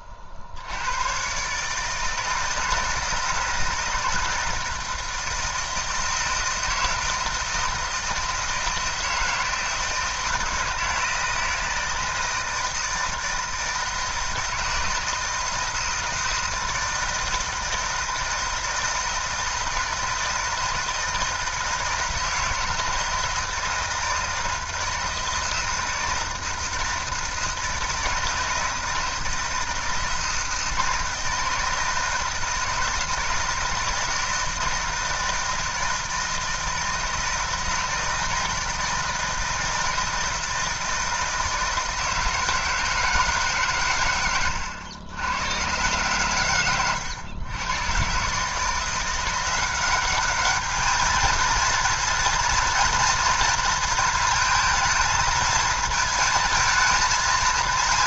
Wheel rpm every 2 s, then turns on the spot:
80, 160, 160, 160, 160, 160, 160, 160, 160, 160, 160, 160, 160, 160, 160, 160, 160, 160, 160, 160, 160, 160, 90, 110, 150, 220, 230, 220, 220.
44-46